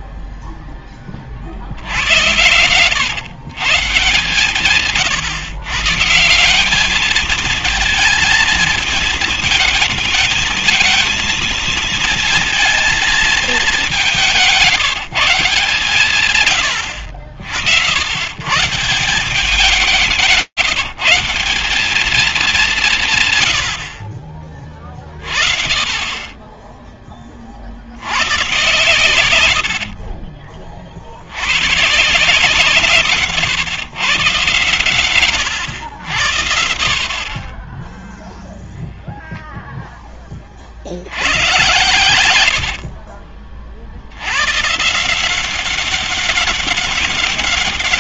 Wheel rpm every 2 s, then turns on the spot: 0, 110, 140, 200, 220, 220, 230, 160, 100, 150, 170, 190, 30, 10, 120, 40, 150, 130, 60, 0, 50, 80, 130, 190.
42-44